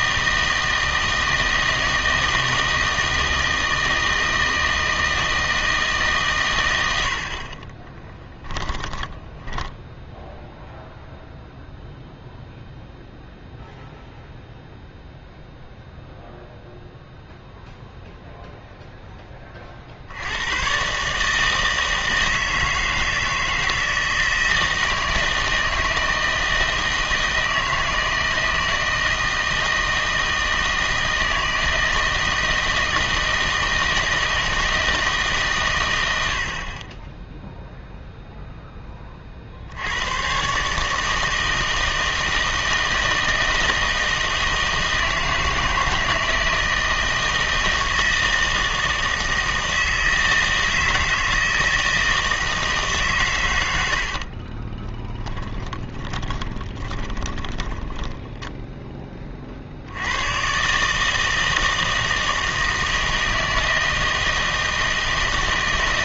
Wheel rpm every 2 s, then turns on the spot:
160, 160, 160, 110, 10, 0, 0, 0, 0, 0, 110, 160, 160, 160, 160, 160, 160, 160, 60, 10, 140, 160, 160, 160, 160, 160, 160, 30, 20, 10, 140, 160, 160.
8-10 54-58